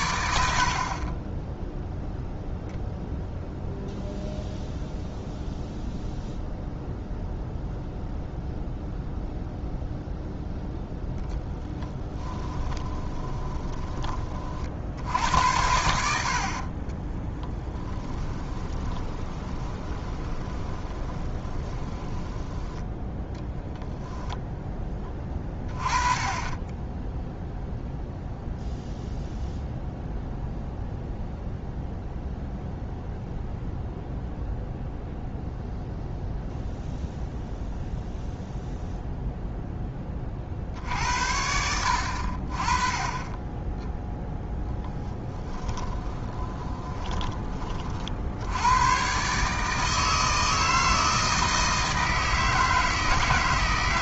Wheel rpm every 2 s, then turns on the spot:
60, 0, 0, 0, 0, 0, 20, 50, 40, 20, 20, 10, 10, 20, 0, 0, 0, 0, 0, 0, 50, 30, 10, 20, 110, 160, 160.
12-14 16-22 44-48